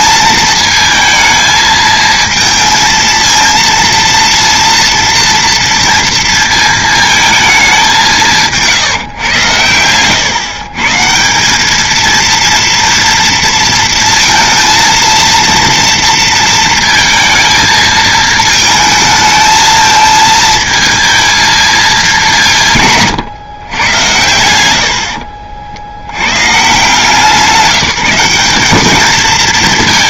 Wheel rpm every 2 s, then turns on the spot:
230, 230, 230, 220, 150, 140, 230, 230, 230, 220, 220, 160, 80, 150, 200.
none